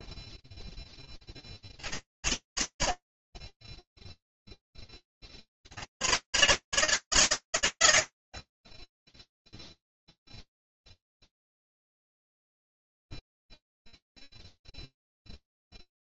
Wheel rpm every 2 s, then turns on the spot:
0, 60, 0, 90, 70, 0, 0, 0.
none